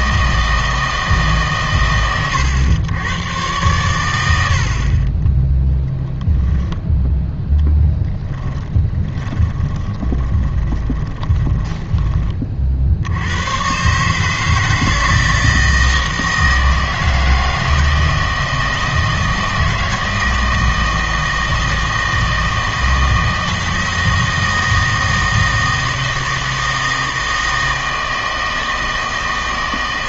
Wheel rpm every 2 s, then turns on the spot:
160, 100, 70, 10, 10, 20, 50, 160, 160, 160, 160, 160, 160, 160, 160.
8-12